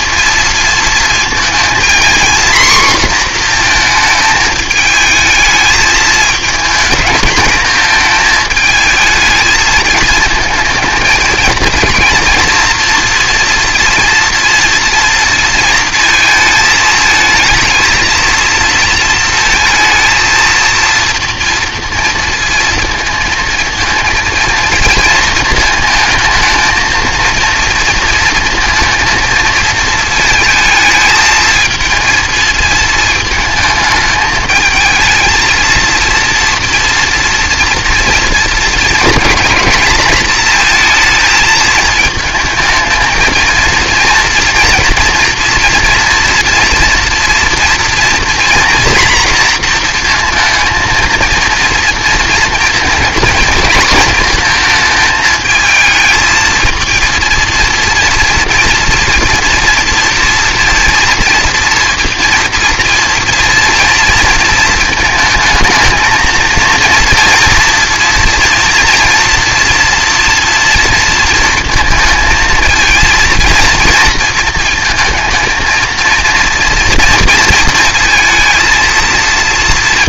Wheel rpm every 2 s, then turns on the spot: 230, 240, 220, 220, 220, 230, 230, 230, 230, 230, 230, 230, 230, 220, 230, 220, 220, 220, 240, 230, 230, 220, 230, 230, 240, 230, 230, 220, 220, 230, 230, 230, 220, 230, 230, 230, 220, 220, 230, 230.
none